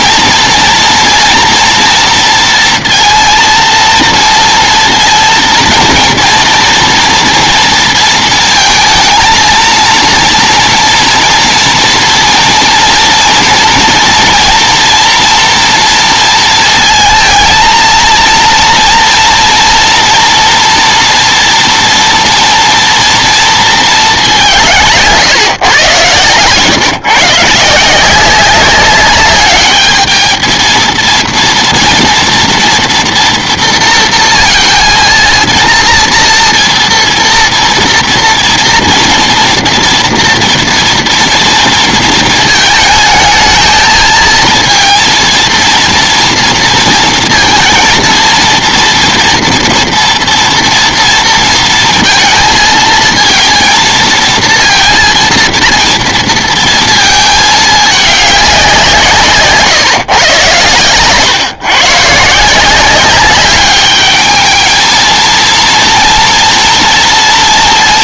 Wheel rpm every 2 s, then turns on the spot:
230, 230, 230, 230, 220, 230, 230, 230, 230, 240, 230, 230, 160, 120, 200, 220, 230, 230, 240, 230, 230, 220, 230, 230, 230, 230, 220, 230, 220, 170, 110, 180, 220, 230.
none